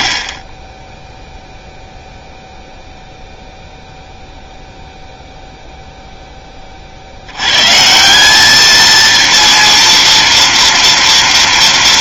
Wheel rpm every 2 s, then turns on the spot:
0, 0, 0, 20, 210, 230.
none